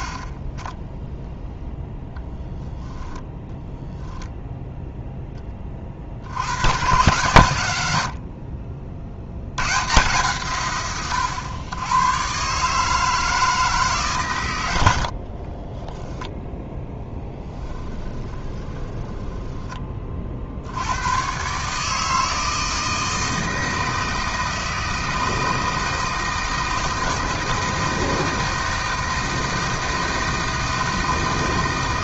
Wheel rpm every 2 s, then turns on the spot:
0, 0, 0, 120, 50, 130, 150, 80, 10, 20, 80, 160, 160, 160, 160, 160.
14-20